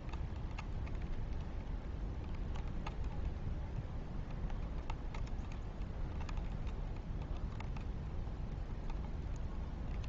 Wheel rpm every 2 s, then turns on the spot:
0, 0, 0, 0, 0.
none